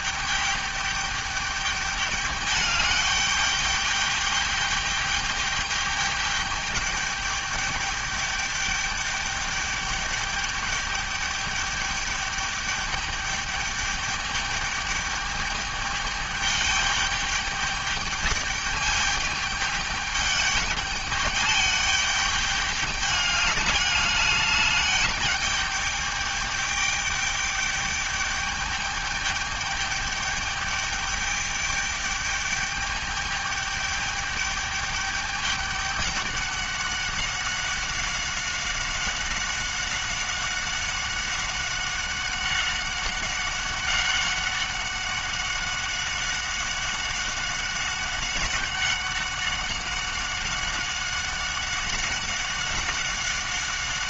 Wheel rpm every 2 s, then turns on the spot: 210, 210, 210, 210, 210, 210, 210, 210, 210, 210, 210, 210, 210, 210, 210, 210, 210, 210, 200, 190, 190, 190, 190, 190, 190, 190, 190.
none